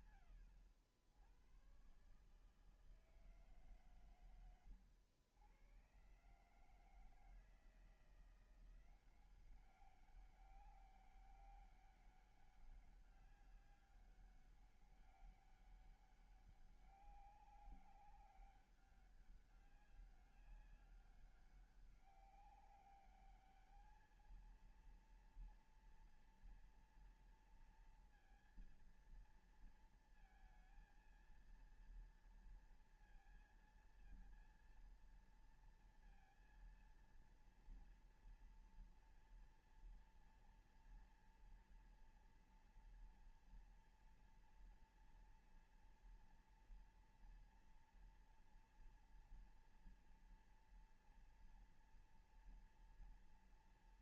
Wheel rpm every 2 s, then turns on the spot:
140, 140, 120, 130, 170, 200, 200, 200, 200, 190, 200, 200, 220, 240, 230, 230, 230, 230, 230, 230, 230, 240, 230, 230, 230, 240, 240.
none